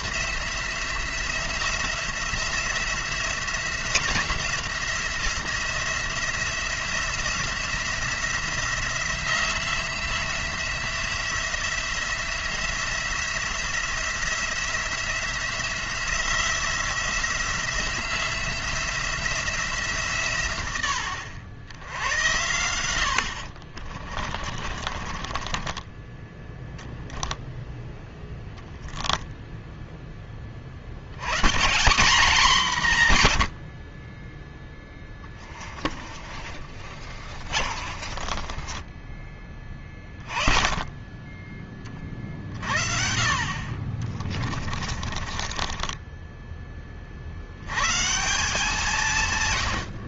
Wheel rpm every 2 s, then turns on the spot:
170, 180, 170, 170, 170, 180, 170, 170, 170, 180, 100, 70, 40, 0, 0, 60, 170, 10, 40, 30, 20, 60, 30, 20, 170.
24-26 34-40 44-46